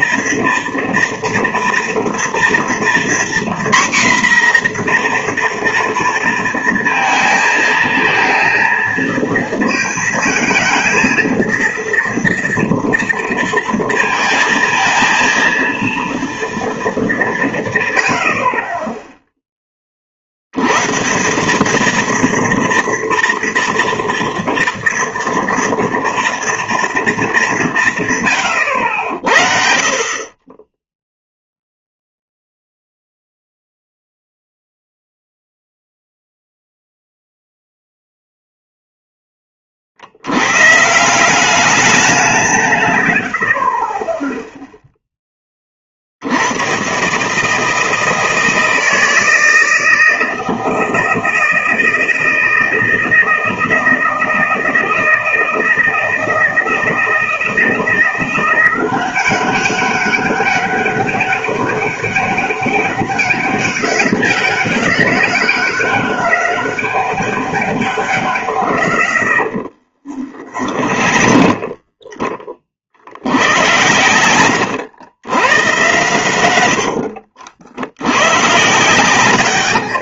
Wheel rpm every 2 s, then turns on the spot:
240, 230, 250, 230, 230, 230, 230, 230, 230, 40, 110, 230, 230, 230, 110, 20, 0, 0, 0, 0, 120, 150, 0, 90, 160, 160, 160, 160, 160, 180, 200, 200, 190, 200, 100, 40, 40, 100, 80, 120.
70-72 74-76